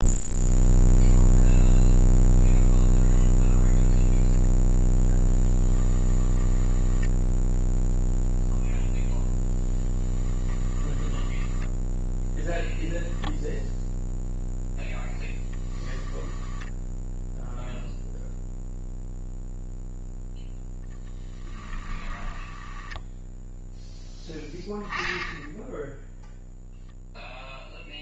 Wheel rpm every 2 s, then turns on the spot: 0, 0, 0, 10, 0, 10, 0, 0, 0, 0, 10, 10, 10, 0.
6-8 10-12 22-24